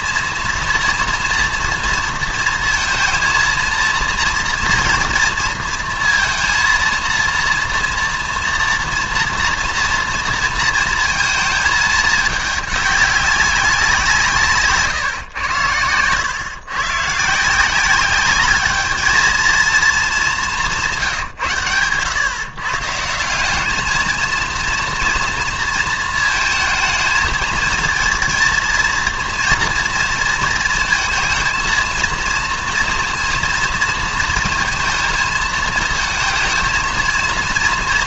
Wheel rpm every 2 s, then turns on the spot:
230, 230, 230, 230, 230, 230, 200, 150, 120, 210, 180, 150, 230, 220, 230, 230, 230, 230, 230.
none